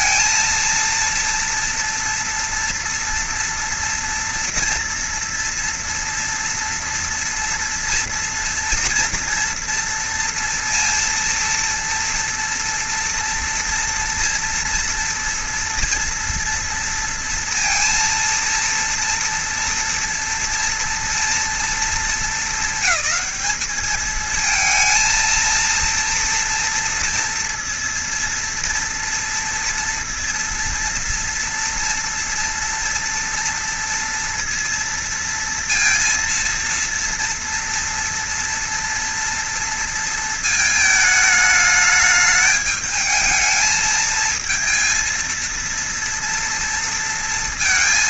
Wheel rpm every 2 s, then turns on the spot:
230, 230, 230, 230, 240, 230, 230, 240, 230, 230, 230, 220, 220, 240, 230, 230, 230, 230, 230, 230, 220, 210, 220, 230.
none